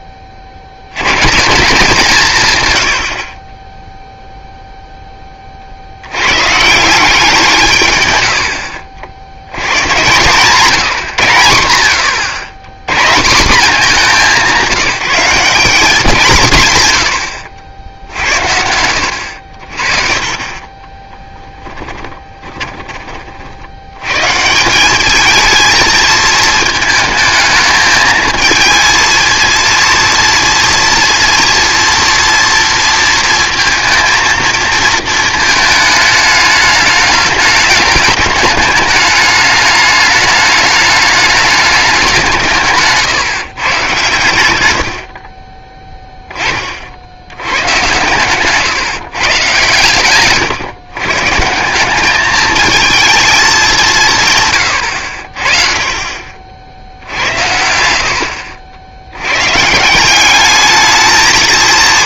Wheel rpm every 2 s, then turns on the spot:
20, 130, 0, 160, 70, 160, 110, 190, 140, 70, 30, 20, 170, 220, 230, 230, 230, 230, 210, 210, 210, 160, 90, 40, 140, 130, 220, 110, 60, 80, 210.
18-22